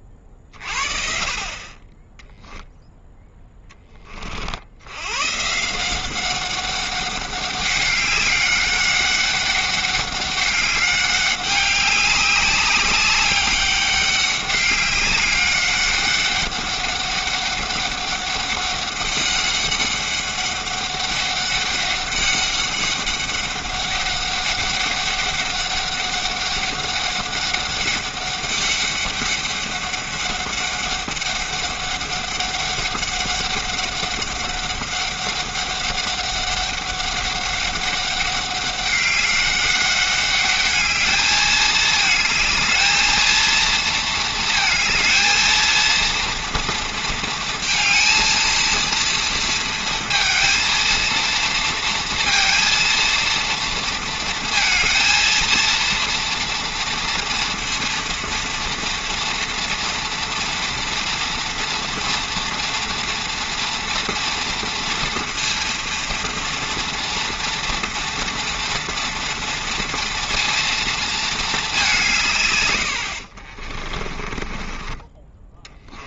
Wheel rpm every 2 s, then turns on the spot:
50, 0, 70, 190, 200, 200, 200, 200, 200, 200, 200, 200, 200, 200, 200, 200, 200, 200, 200, 190, 210, 220, 220, 230, 230, 230, 230, 230, 230, 230, 230, 240, 230, 230, 230, 230, 110, 30.
74-76